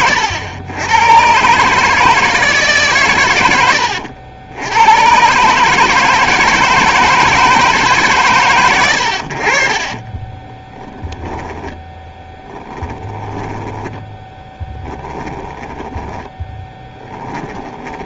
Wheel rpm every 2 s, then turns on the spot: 90, 140, 100, 160, 100, 10, 10, 30, 20.
10-18